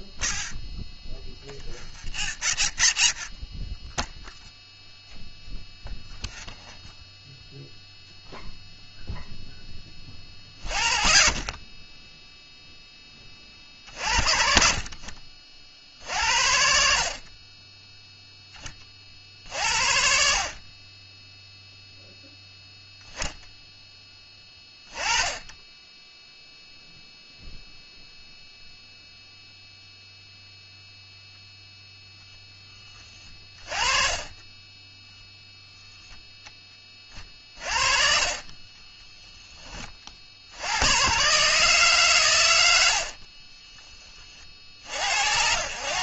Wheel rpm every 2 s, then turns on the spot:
0, 0, 0, 0, 0, 30, 20, 40, 50, 60, 10, 10, 20, 0, 0, 0, 20, 0, 30, 10, 140, 60, 90.
32-34 36-38 42-44